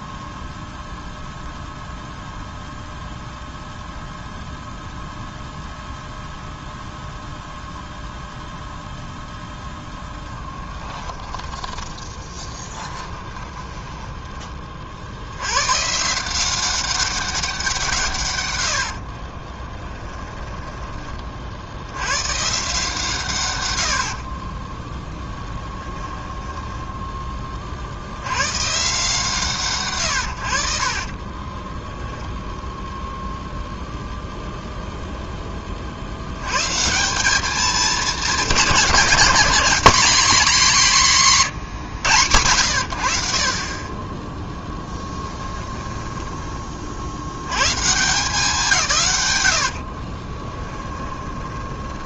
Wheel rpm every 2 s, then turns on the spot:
0, 0, 0, 0, 0, 20, 20, 40, 190, 70, 20, 150, 30, 10, 140, 40, 0, 0, 140, 200, 200, 80, 10, 30, 160, 10.
10-14 18-20 24-28 44-46 50-52